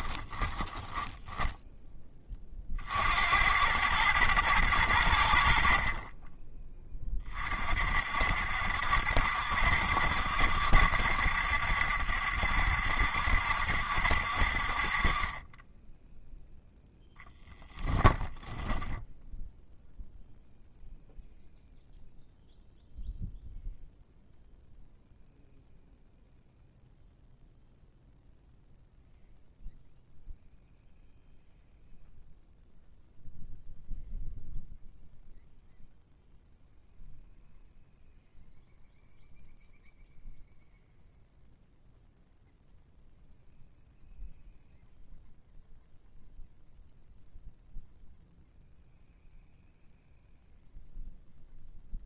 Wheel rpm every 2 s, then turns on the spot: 10, 50, 100, 20, 60, 70, 70, 50, 10, 10, 0, 0, 0, 0, 0, 0, 0, 0, 0, 0, 0, 0, 0, 0, 0, 0.
0-2 16-18